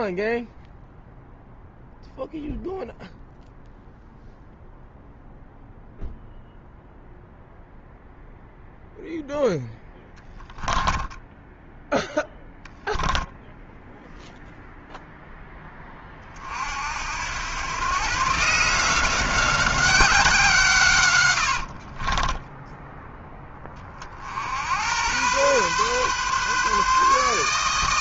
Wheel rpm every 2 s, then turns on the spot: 0, 0, 0, 0, 0, 10, 0, 0, 50, 160, 160, 10, 70, 140.
10-12 22-24